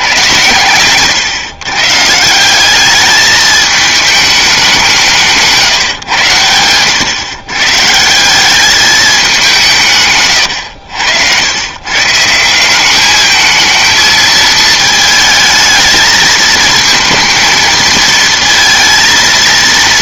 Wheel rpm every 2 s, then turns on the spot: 110, 190, 190, 110, 200, 100, 180, 220, 220, 230.
0-2 10-12